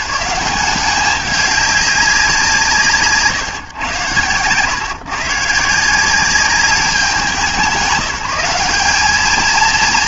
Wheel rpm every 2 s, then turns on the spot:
190, 170, 130, 190, 190.
none